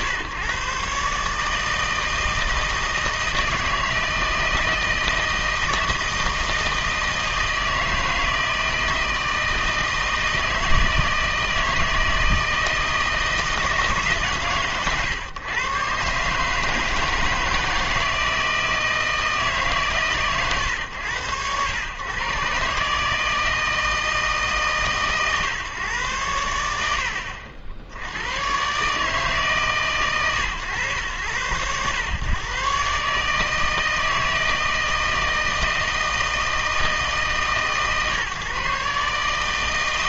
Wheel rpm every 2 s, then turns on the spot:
140, 160, 160, 160, 160, 160, 160, 130, 150, 160, 120, 140, 150, 90, 130, 110, 130, 160, 160, 150.
none